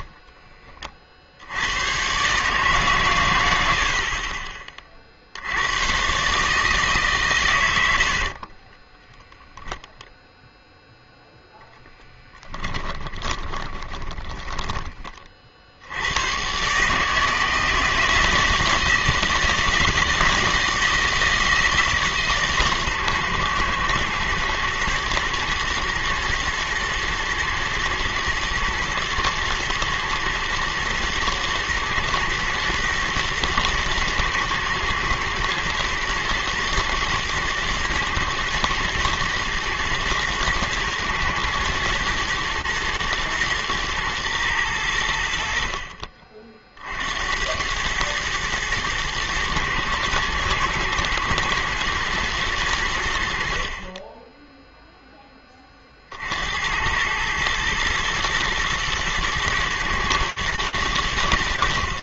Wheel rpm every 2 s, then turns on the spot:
10, 140, 30, 140, 30, 0, 20, 20, 120, 160, 160, 140, 120, 120, 120, 110, 110, 110, 110, 110, 120, 120, 110, 50, 110, 110, 120, 20, 80, 120, 110.
8-10 12-16